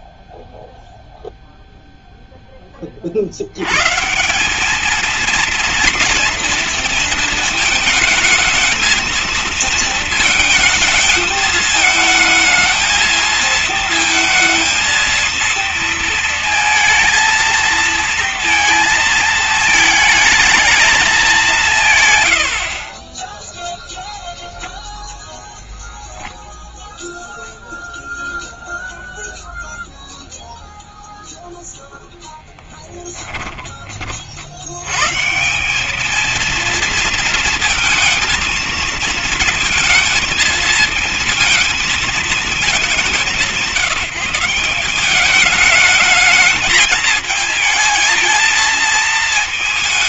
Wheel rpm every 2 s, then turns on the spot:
0, 20, 210, 230, 220, 220, 220, 230, 220, 230, 220, 70, 0, 0, 0, 0, 10, 80, 230, 230, 230, 200, 170, 220, 220.
none